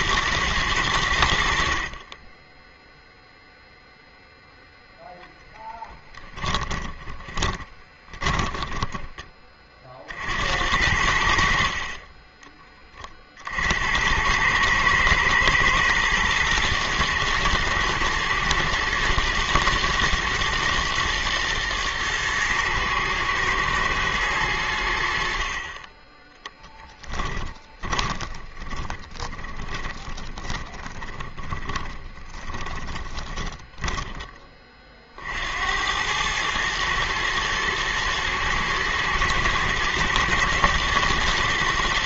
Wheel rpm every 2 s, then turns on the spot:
110, 10, 0, 20, 20, 70, 40, 110, 110, 110, 120, 120, 60, 20, 20, 20, 20, 60, 110, 110, 110.
6-10 26-34